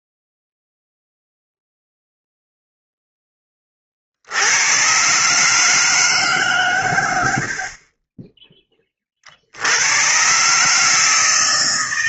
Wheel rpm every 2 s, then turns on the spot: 0, 0, 80, 140, 20, 130.
8-10